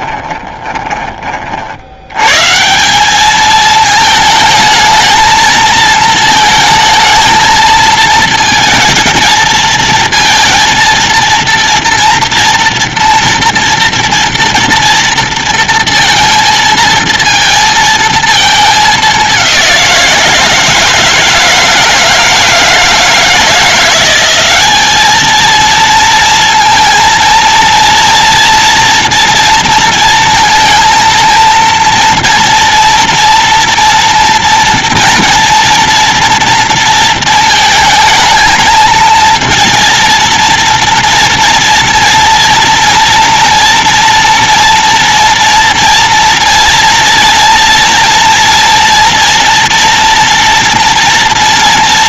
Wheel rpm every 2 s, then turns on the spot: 30, 190, 220, 220, 220, 230, 230, 230, 230, 210, 160, 160, 210, 230, 230, 230, 230, 230, 230, 220, 240, 240, 230, 230, 230, 230.
none